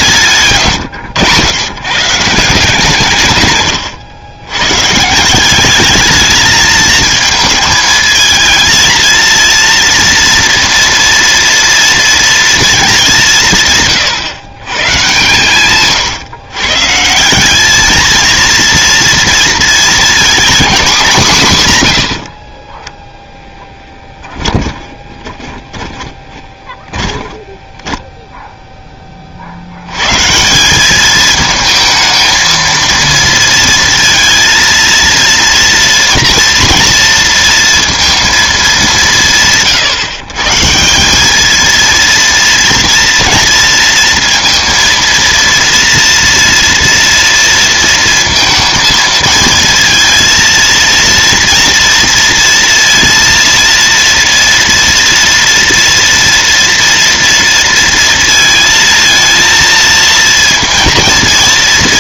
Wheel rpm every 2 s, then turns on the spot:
110, 130, 180, 220, 230, 230, 180, 130, 180, 230, 180, 10, 20, 10, 10, 200, 230, 230, 230, 200, 170, 230, 230, 230, 230, 230, 230, 230, 230, 220, 230.
22-28